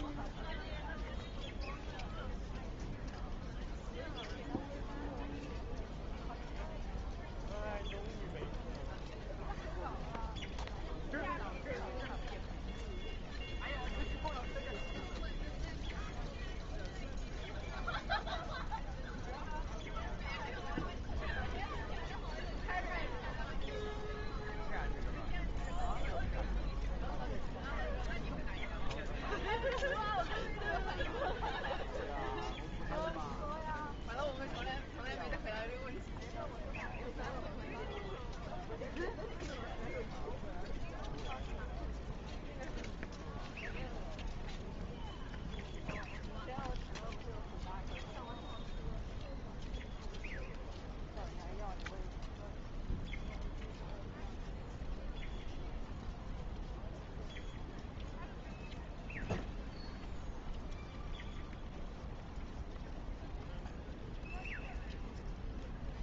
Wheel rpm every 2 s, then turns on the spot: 0, 0, 0, 0, 0, 0, 0, 0, 0, 0, 0, 0, 0, 0, 0, 0, 0, 0, 0, 0, 0, 0, 0, 0, 0, 0, 0, 0, 0, 0, 0, 0, 0.
none